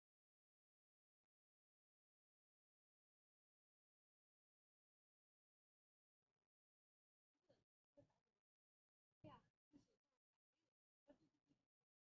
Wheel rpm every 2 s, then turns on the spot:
0, 0, 0, 0, 0, 0.
none